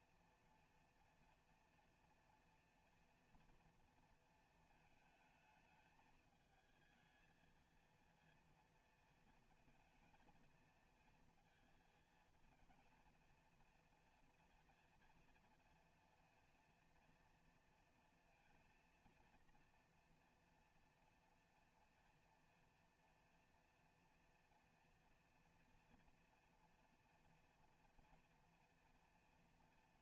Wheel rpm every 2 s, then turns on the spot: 230, 230, 230, 220, 230, 220, 220, 230, 240, 230, 230, 230, 230, 230, 230.
none